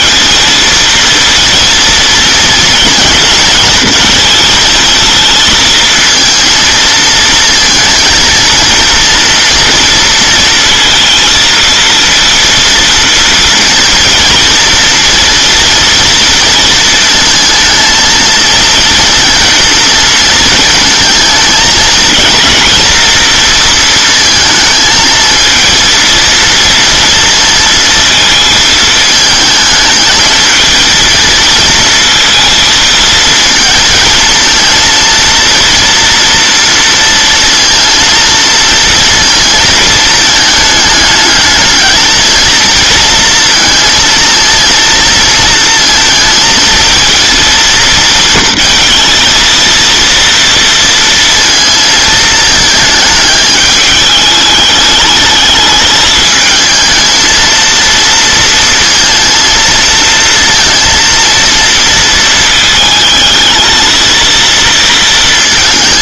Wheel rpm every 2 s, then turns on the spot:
230, 230, 230, 230, 230, 230, 230, 230, 230, 220, 220, 230, 220, 230, 220, 220, 230, 230, 230, 230, 220, 230, 220, 220, 230, 230, 220, 210, 220, 230, 230, 220, 230.
none